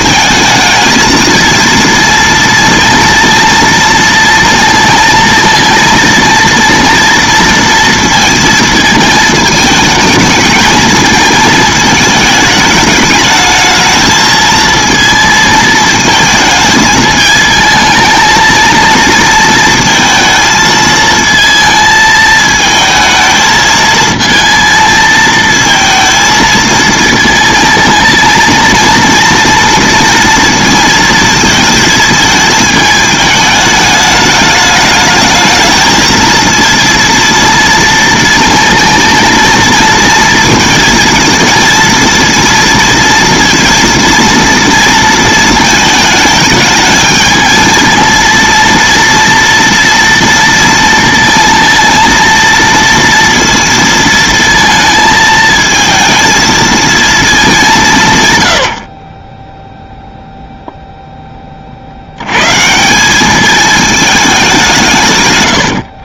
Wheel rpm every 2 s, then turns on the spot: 220, 230, 230, 230, 220, 220, 210, 230, 220, 220, 220, 220, 220, 220, 230, 230, 220, 210, 230, 230, 230, 230, 230, 210, 230, 230, 230, 220, 230, 90, 0, 160, 180.
none